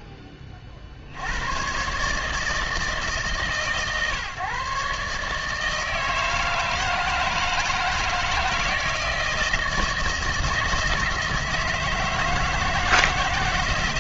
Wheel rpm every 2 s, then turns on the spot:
30, 150, 140, 160, 160, 160, 160.
none